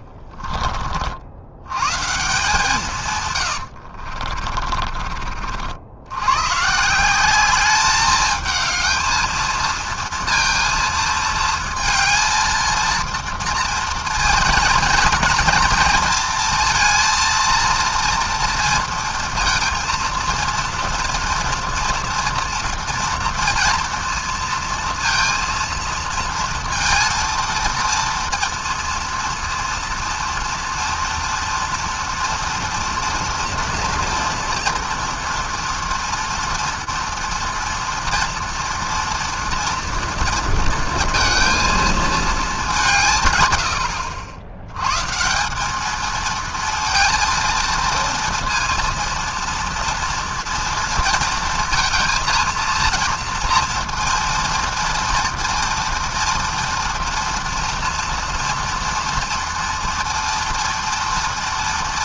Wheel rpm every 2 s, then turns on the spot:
30, 160, 40, 140, 220, 230, 220, 230, 230, 230, 230, 230, 230, 230, 230, 230, 240, 230, 230, 240, 230, 200, 100, 230, 230, 230, 230, 230, 230, 240, 230.
0-2 4-6